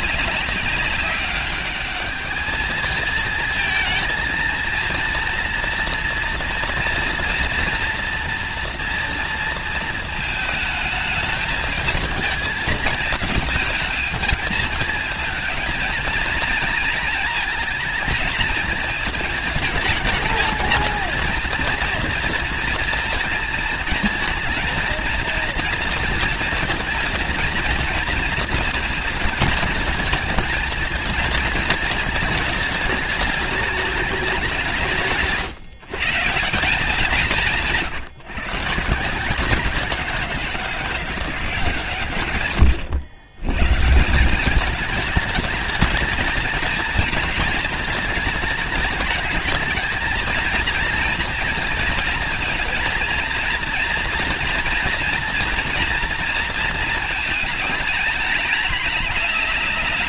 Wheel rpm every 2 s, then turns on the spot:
190, 210, 230, 230, 240, 220, 220, 220, 230, 230, 220, 230, 230, 230, 230, 220, 220, 190, 180, 140, 170, 120, 190, 220, 220, 220, 230, 240, 230, 230.
none